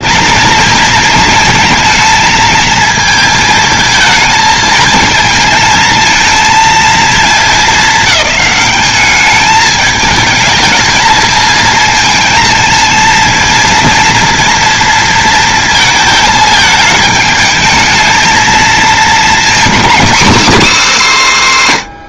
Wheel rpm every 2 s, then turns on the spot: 230, 220, 220, 220, 210, 220, 230, 230, 220, 220, 220.
none